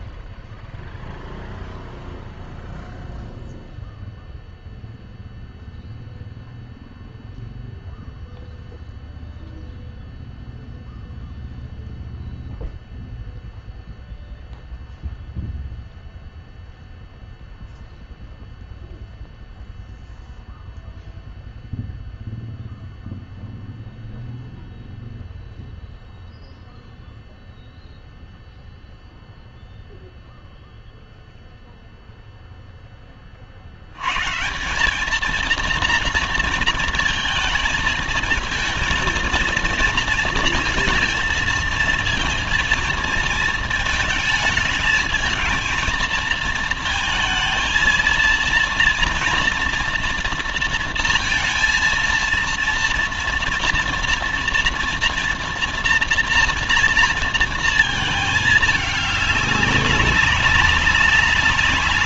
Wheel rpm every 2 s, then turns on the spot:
0, 0, 0, 0, 0, 0, 0, 0, 0, 0, 0, 0, 0, 0, 0, 0, 0, 150, 230, 230, 230, 230, 220, 220, 230, 230, 230, 230, 230, 220, 190.
none